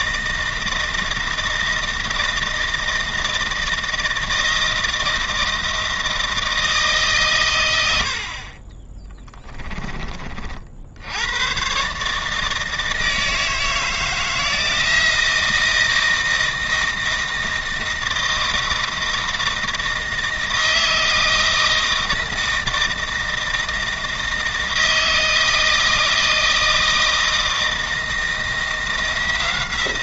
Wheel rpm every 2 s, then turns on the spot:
160, 160, 160, 150, 20, 70, 160, 160, 160, 160, 160, 160, 160, 160, 170.
8-10